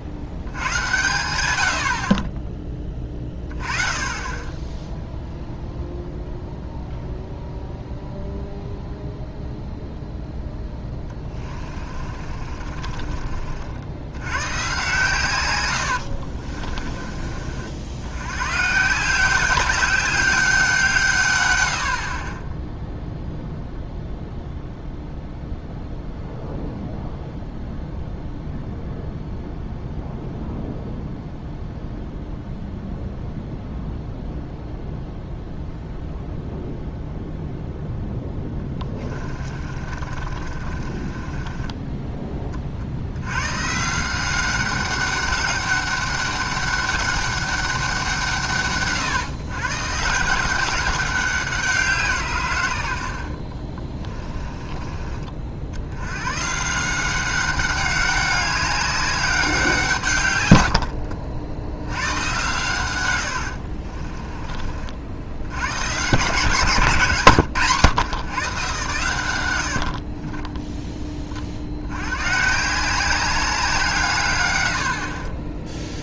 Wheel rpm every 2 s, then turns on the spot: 90, 20, 20, 0, 0, 10, 40, 130, 40, 140, 170, 10, 0, 0, 0, 0, 0, 0, 0, 10, 30, 30, 190, 200, 150, 190, 110, 20, 150, 200, 100, 120, 40, 160, 120, 10, 160, 90.
10-14 16-18 38-42 60-62 70-72